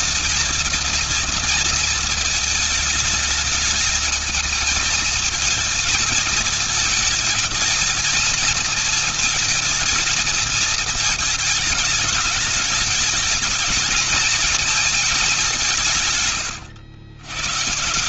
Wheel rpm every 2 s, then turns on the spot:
220, 220, 220, 220, 220, 220, 210, 220, 130.
none